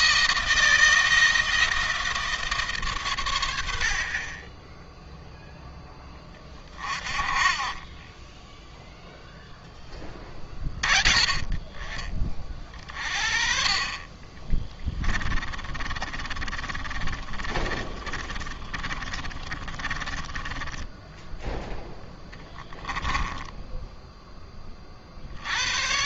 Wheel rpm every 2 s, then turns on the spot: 160, 130, 10, 30, 0, 20, 40, 20, 30, 30, 10, 10, 40.
14-24